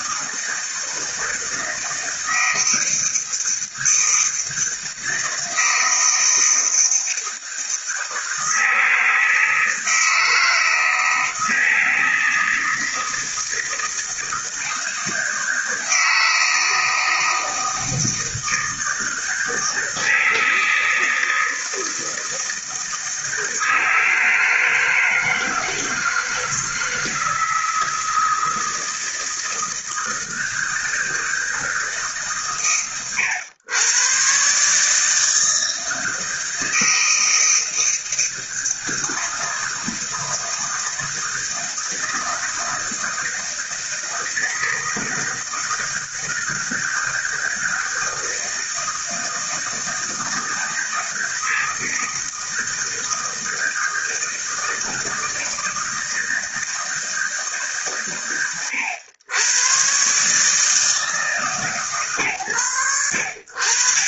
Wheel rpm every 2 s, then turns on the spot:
160, 160, 160, 160, 160, 160, 160, 160, 160, 160, 160, 160, 160, 160, 160, 160, 120, 140, 160, 160, 160, 160, 160, 160, 160, 160, 160, 160, 160, 100, 160, 110.
none